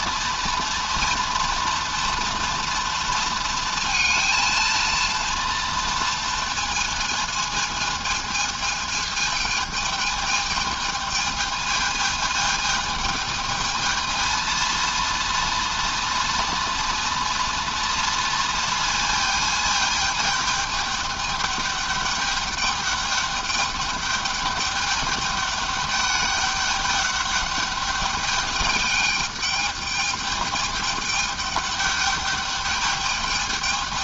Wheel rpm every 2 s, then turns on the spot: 230, 230, 230, 220, 220, 220, 220, 230, 230, 230, 210, 200, 210, 200, 210, 210, 210.
none